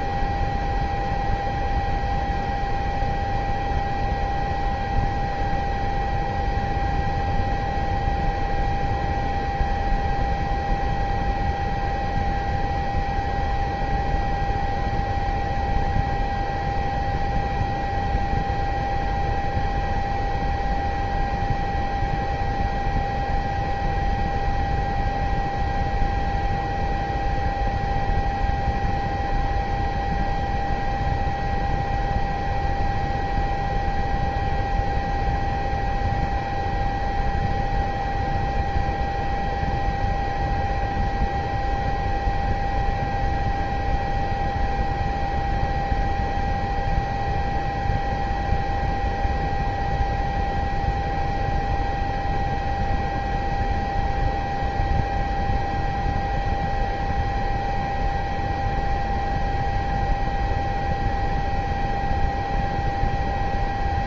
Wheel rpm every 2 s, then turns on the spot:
0, 0, 0, 0, 0, 0, 0, 0, 0, 0, 0, 0, 0, 0, 0, 0, 0, 0, 0, 0, 0, 0, 0, 0, 0, 0, 0, 0, 0, 0, 0, 0.
none